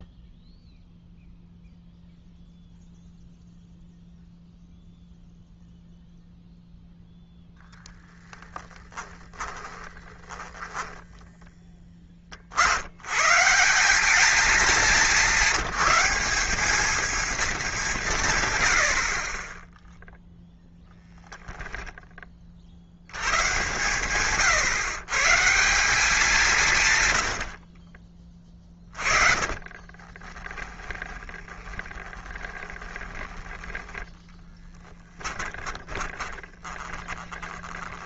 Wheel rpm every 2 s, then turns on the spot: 0, 0, 0, 0, 20, 10, 80, 210, 220, 90, 0, 70, 140, 150, 30, 20, 20, 10, 20.
8-12 28-34 36-38